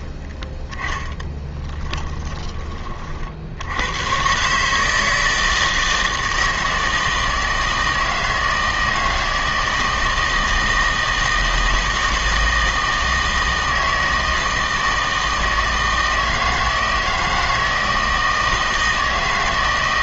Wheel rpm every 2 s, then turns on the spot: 10, 20, 140, 160, 160, 160, 160, 160, 160, 160.
0-2